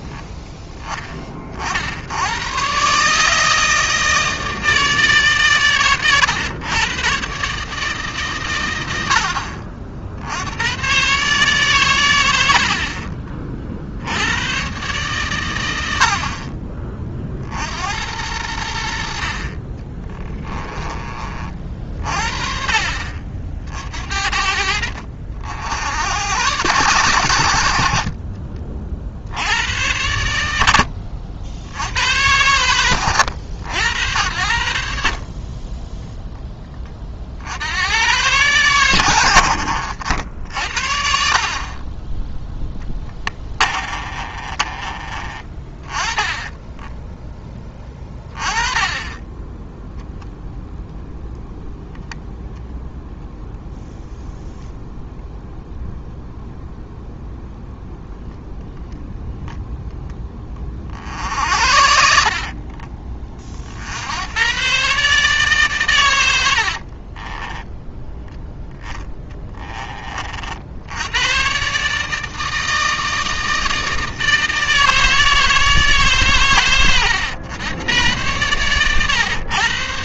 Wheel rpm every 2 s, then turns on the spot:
10, 120, 160, 110, 110, 110, 50, 130, 40, 80, 20, 50, 70, 120, 50, 80, 100, 70, 20, 120, 70, 10, 30, 20, 20, 0, 0, 0, 0, 0, 30, 30, 120, 60, 10, 70, 160, 160, 110, 120.
20-24 42-48 66-68